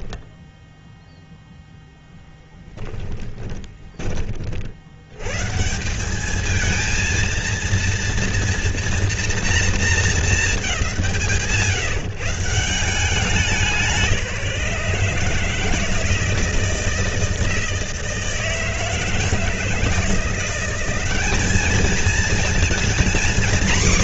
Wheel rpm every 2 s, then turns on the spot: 0, 10, 40, 210, 230, 190, 150, 160, 160, 160, 180, 230.
none